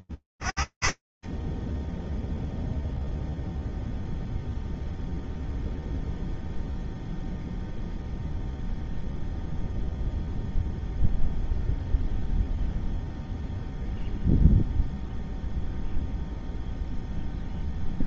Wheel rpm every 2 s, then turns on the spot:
40, 0, 0, 0, 0, 0, 0, 0, 0.
none